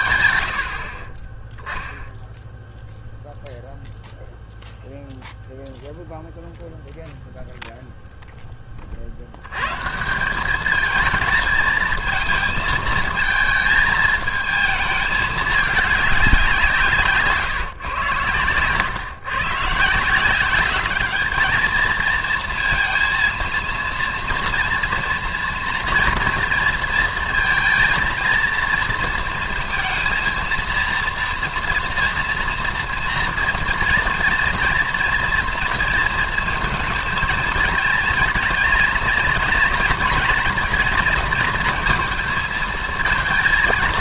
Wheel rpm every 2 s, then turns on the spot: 60, 0, 0, 0, 40, 210, 220, 220, 160, 120, 200, 230, 230, 230, 220, 230, 240, 230, 220, 230, 230, 220.
none